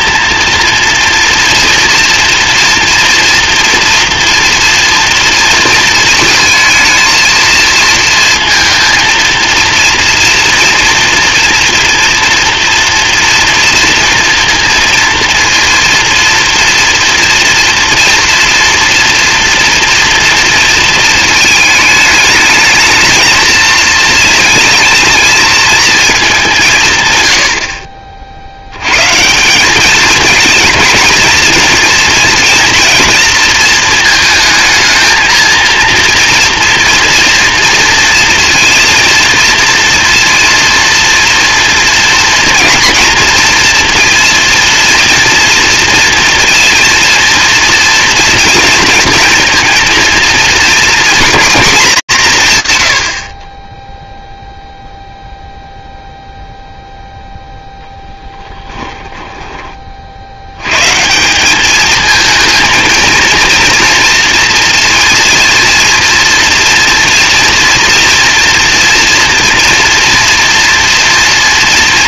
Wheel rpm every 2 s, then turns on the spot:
230, 240, 230, 220, 230, 230, 230, 230, 240, 240, 220, 220, 220, 180, 90, 230, 230, 220, 230, 230, 230, 230, 230, 230, 230, 230, 150, 0, 0, 10, 120, 230, 230, 230, 230, 240.
58-60